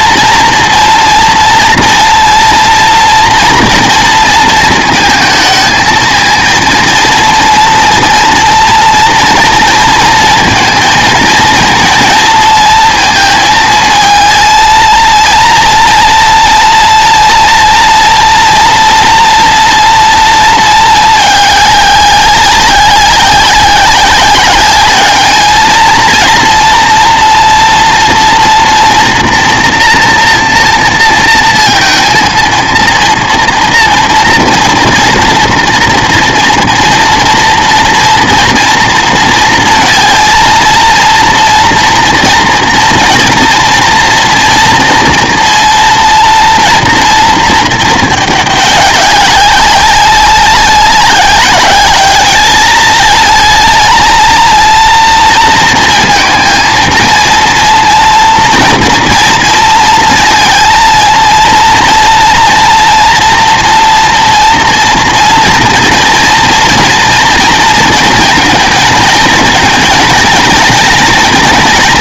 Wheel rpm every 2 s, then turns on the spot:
230, 230, 230, 230, 240, 230, 230, 230, 230, 230, 220, 190, 200, 230, 240, 230, 230, 230, 230, 230, 230, 230, 230, 230, 210, 200, 220, 230, 230, 230, 230, 230, 240, 240, 230, 240.
none